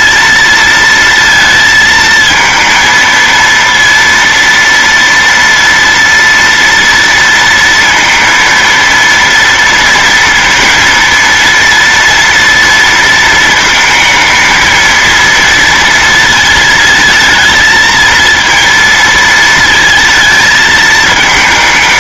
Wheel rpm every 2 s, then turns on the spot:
230, 230, 230, 230, 230, 230, 230, 230, 220, 230, 220.
none